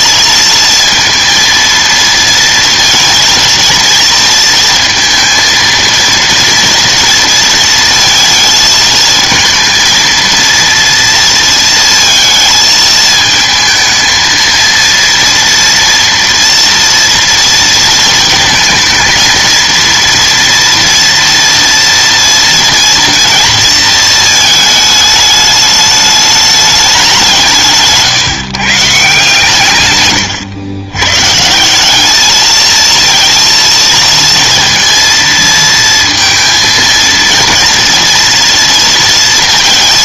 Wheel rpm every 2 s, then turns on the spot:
230, 230, 230, 230, 230, 230, 220, 230, 230, 230, 230, 230, 220, 210, 160, 100, 220, 230, 230, 230.
none